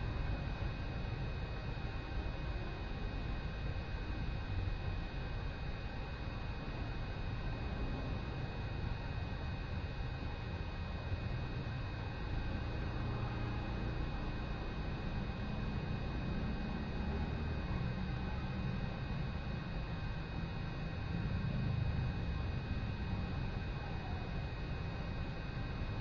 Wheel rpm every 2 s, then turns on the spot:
0, 0, 0, 0, 0, 0, 0, 0, 0, 0, 0, 0, 0.
none